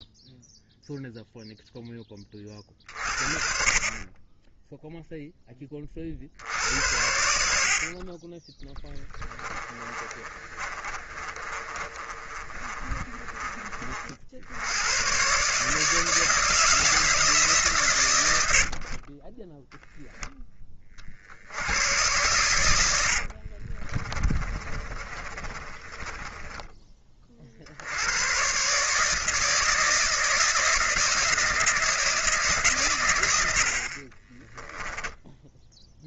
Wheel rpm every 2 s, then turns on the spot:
0, 40, 0, 80, 10, 30, 30, 100, 160, 50, 20, 90, 30, 20, 140, 170, 130, 10.
8-14 22-26 34-36